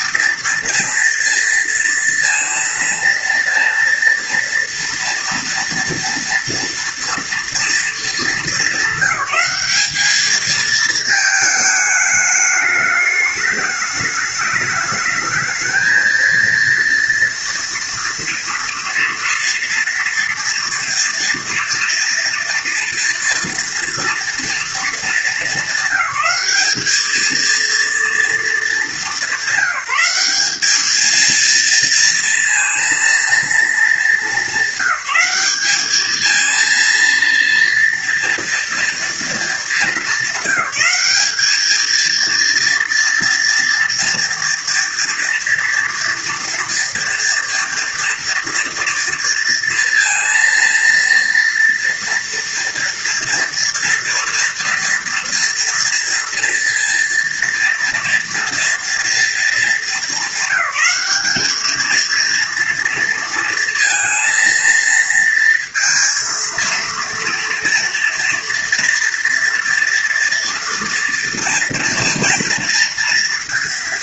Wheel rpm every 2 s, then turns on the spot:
230, 230, 240, 230, 210, 220, 210, 210, 230, 230, 230, 230, 230, 200, 220, 210, 230, 190, 230, 240, 210, 230, 230, 230, 230, 230, 230, 230, 230, 230, 220, 230, 230, 230, 230, 230, 230.
none